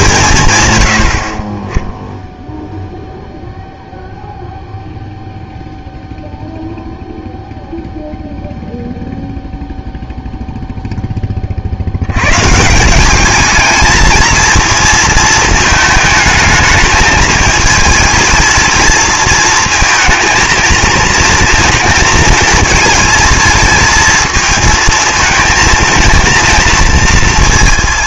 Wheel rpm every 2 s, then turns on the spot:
110, 0, 0, 0, 0, 0, 160, 230, 220, 220, 230, 230, 220, 230.
none